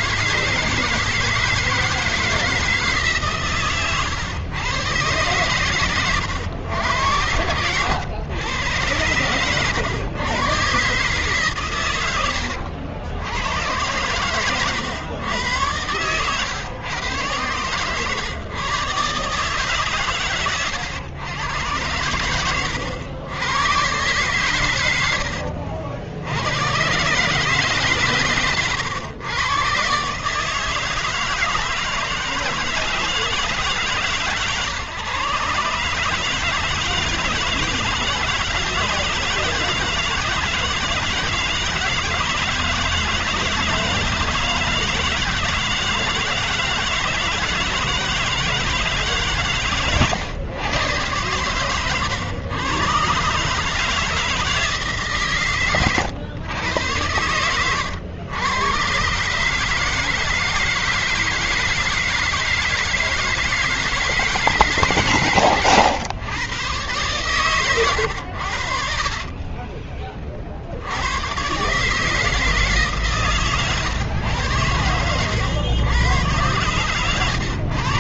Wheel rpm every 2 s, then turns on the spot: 170, 160, 130, 110, 100, 110, 110, 110, 120, 110, 130, 100, 130, 80, 140, 130, 160, 140, 150, 160, 170, 160, 160, 160, 160, 120, 120, 150, 110, 100, 160, 160, 160, 120, 90, 40, 150, 120, 110.
none